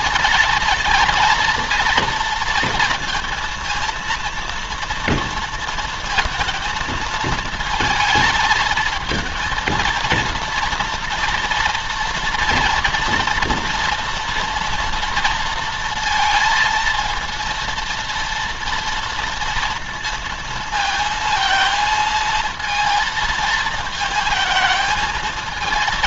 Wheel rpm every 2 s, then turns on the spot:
230, 230, 230, 230, 220, 230, 240, 240, 230, 230, 230, 230, 220.
none